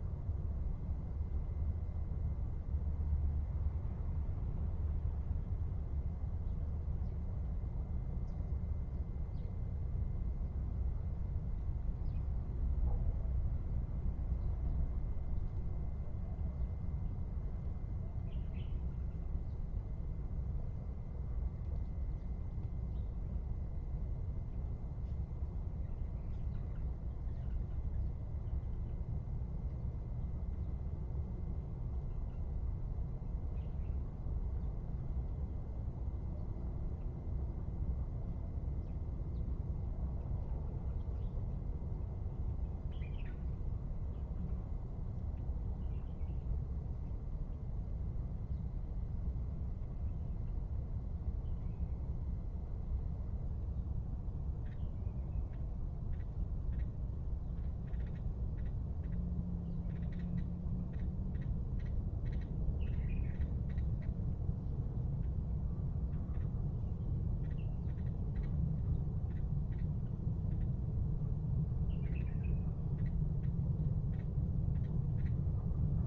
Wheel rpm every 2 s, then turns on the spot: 0, 0, 0, 0, 0, 0, 0, 0, 0, 0, 0, 0, 0, 0, 0, 0, 0, 0, 0, 0, 0, 0, 0, 0, 0, 0, 0, 0, 0, 0, 0, 0, 0, 0, 0, 0, 0, 0.
none